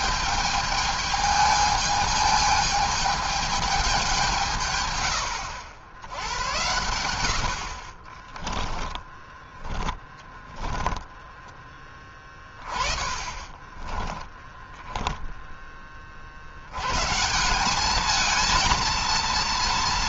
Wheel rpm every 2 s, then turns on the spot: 210, 210, 150, 100, 20, 10, 30, 10, 80, 220.
8-16